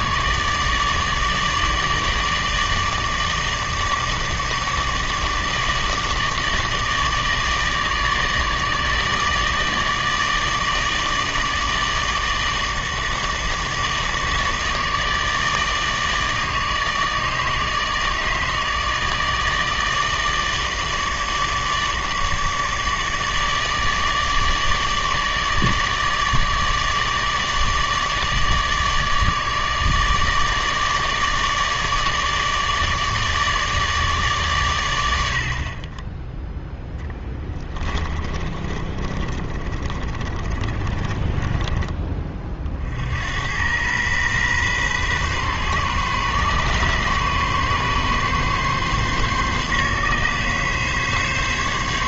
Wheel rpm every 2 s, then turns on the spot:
150, 160, 150, 150, 150, 150, 160, 150, 150, 150, 150, 150, 150, 150, 150, 150, 150, 120, 0, 30, 30, 40, 120, 140, 140, 140.
38-42